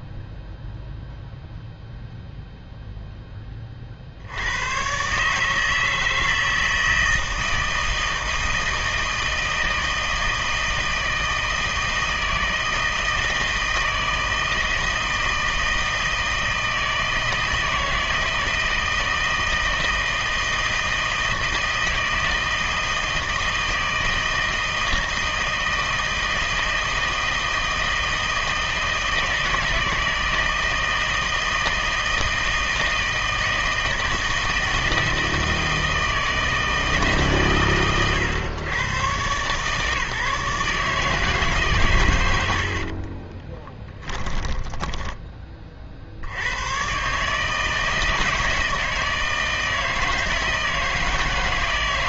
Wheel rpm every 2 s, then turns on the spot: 0, 0, 100, 160, 160, 160, 160, 160, 160, 160, 160, 160, 160, 160, 160, 160, 160, 160, 160, 130, 150, 70, 10, 100, 160, 160.
44-46